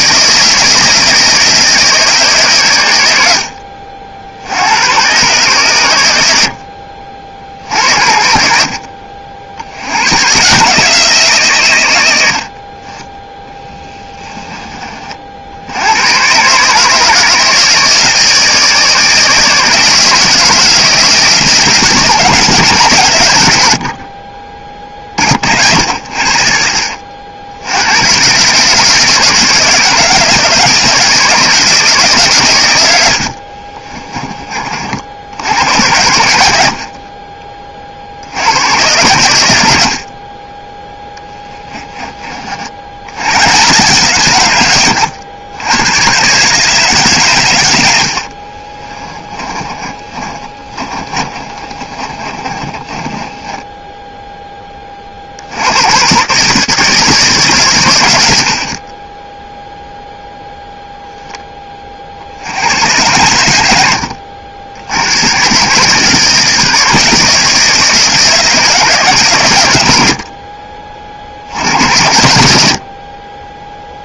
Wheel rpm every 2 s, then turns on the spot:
160, 130, 90, 70, 60, 150, 50, 20, 140, 160, 160, 150, 30, 50, 140, 160, 120, 40, 70, 90, 20, 50, 120, 150, 40, 30, 20, 20, 140, 40, 0, 80, 80, 160, 160, 50, 80.
36-38 48-54